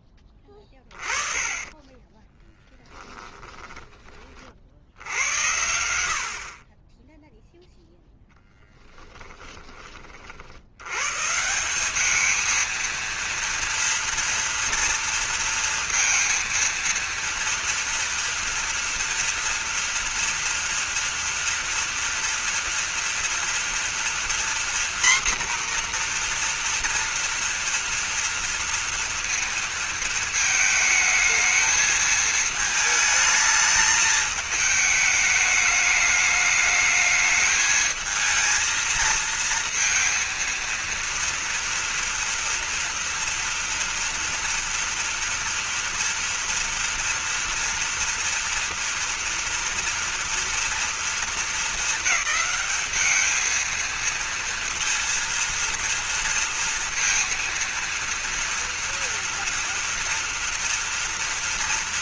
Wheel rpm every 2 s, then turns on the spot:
20, 10, 70, 40, 10, 100, 220, 230, 230, 230, 230, 230, 240, 240, 230, 220, 220, 210, 210, 220, 230, 230, 230, 230, 230, 230, 200, 230, 230, 240, 230.
0-4 8-10